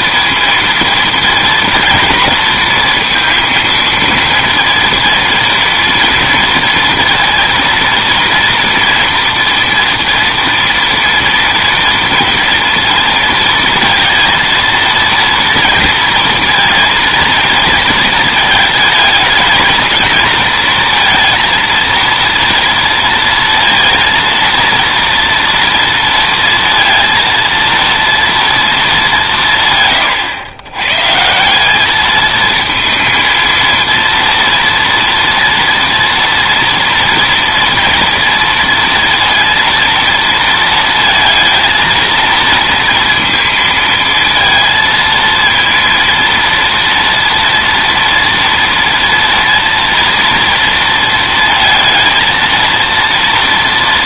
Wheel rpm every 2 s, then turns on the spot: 230, 240, 230, 230, 230, 240, 230, 230, 230, 220, 230, 230, 230, 230, 230, 110, 220, 230, 230, 230, 230, 230, 230, 230, 230, 230, 230.
none